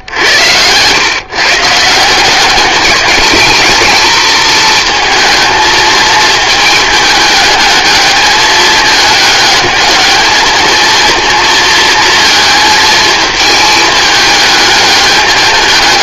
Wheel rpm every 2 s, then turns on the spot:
100, 200, 220, 220, 210, 220, 230, 210.
none